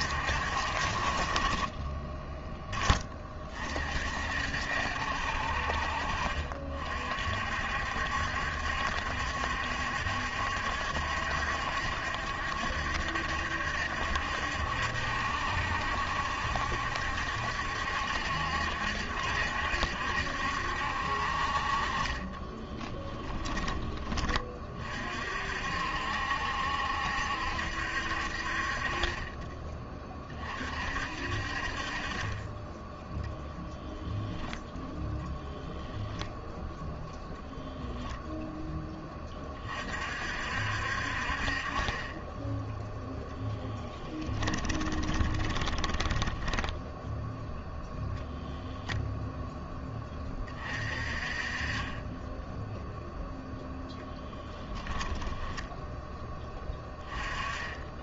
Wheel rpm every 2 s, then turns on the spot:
50, 10, 60, 50, 70, 70, 70, 70, 70, 70, 70, 10, 40, 70, 40, 50, 10, 10, 10, 20, 60, 0, 20, 10, 0, 30, 0, 10, 10.
22-24 44-48 54-56